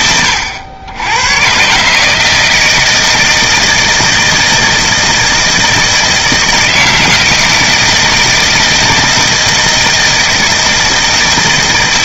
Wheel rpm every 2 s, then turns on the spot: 90, 160, 160, 160, 160, 160.
none